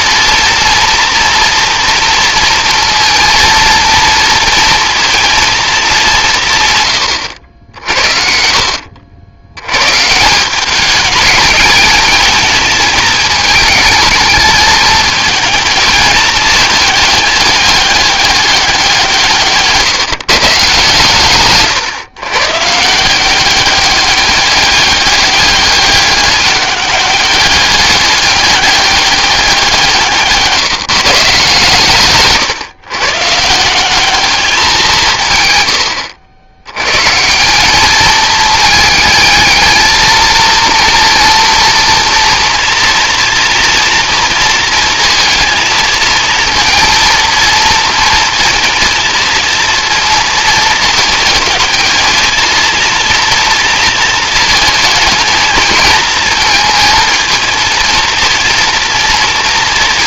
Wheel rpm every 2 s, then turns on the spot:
230, 230, 230, 120, 70, 210, 220, 220, 220, 190, 140, 160, 200, 200, 200, 170, 130, 190, 130, 220, 230, 230, 230, 230, 230, 220, 230, 220, 220, 230.
none